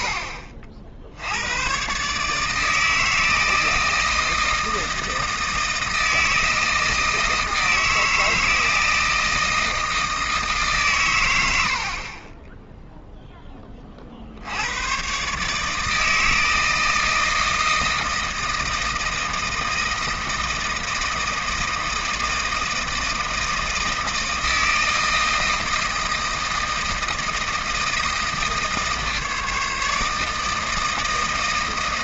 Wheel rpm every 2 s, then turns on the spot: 50, 150, 160, 160, 160, 150, 0, 90, 160, 160, 160, 160, 160, 160, 160, 160.
none